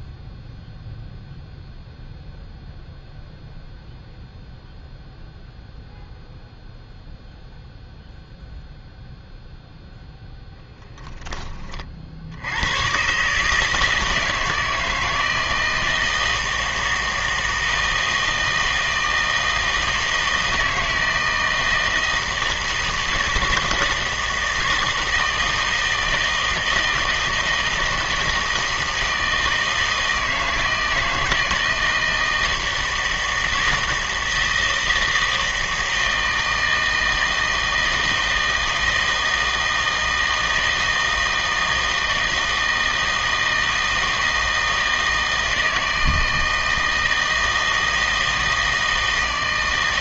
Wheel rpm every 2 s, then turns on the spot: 0, 0, 0, 0, 0, 0, 100, 160, 160, 160, 160, 160, 160, 160, 160, 160, 160, 160, 160, 160, 160, 160, 160, 160, 160.
none